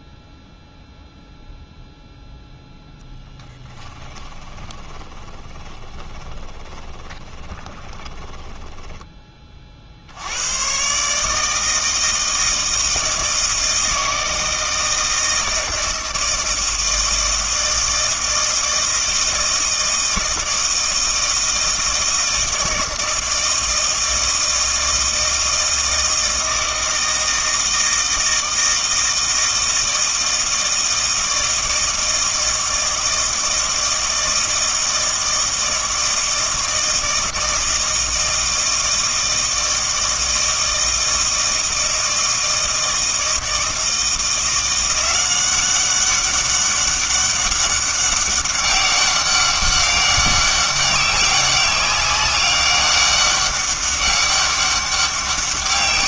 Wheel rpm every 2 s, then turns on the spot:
0, 10, 30, 20, 10, 130, 160, 160, 160, 160, 160, 160, 160, 160, 160, 160, 160, 160, 160, 160, 160, 160, 170, 200, 200, 200, 200, 200.
4-10